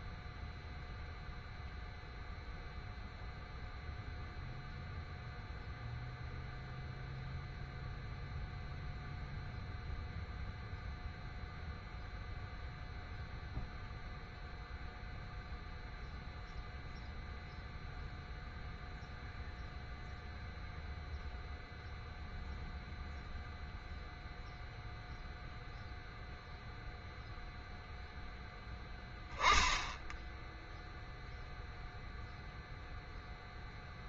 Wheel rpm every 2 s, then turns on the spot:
0, 0, 0, 0, 0, 0, 0, 0, 0, 0, 0, 0, 0, 0, 0, 0, 0.
none